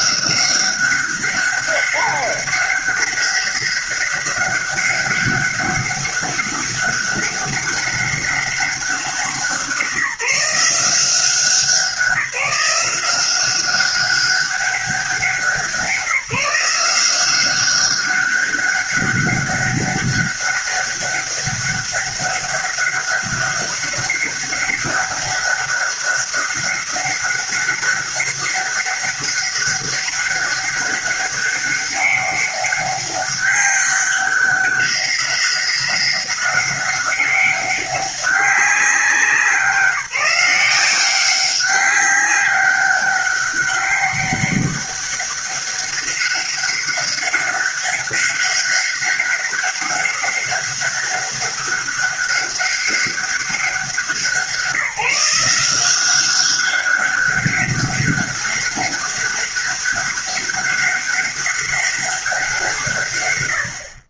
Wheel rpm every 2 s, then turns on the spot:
190, 200, 200, 200, 190, 170, 180, 190, 180, 190, 200, 200, 200, 200, 200, 200, 200, 200, 200, 190, 180, 200, 200, 200, 200, 190, 200, 170, 190, 200, 200, 180.
none